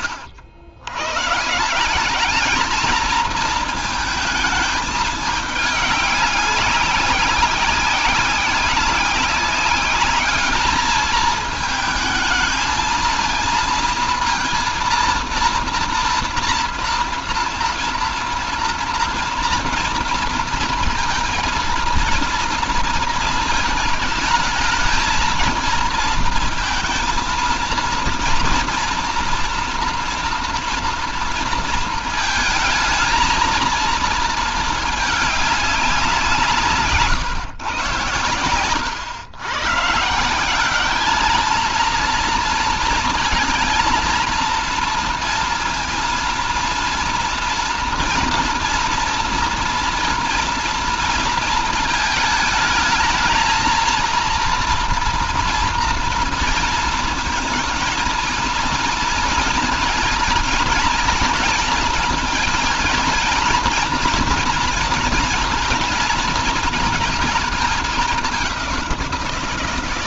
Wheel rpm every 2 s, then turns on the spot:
110, 220, 220, 200, 190, 210, 220, 230, 230, 230, 230, 230, 220, 230, 230, 240, 220, 220, 160, 100, 200, 230, 230, 230, 240, 230, 220, 230, 230, 230, 230, 230, 230, 230, 190.
none